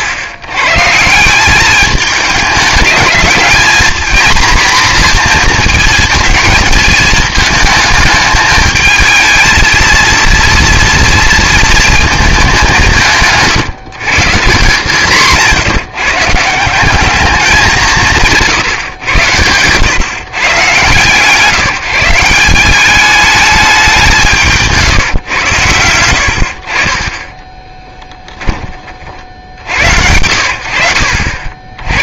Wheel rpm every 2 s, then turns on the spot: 120, 210, 240, 220, 220, 230, 200, 160, 160, 160, 120, 180, 160, 60, 10, 90.
28-30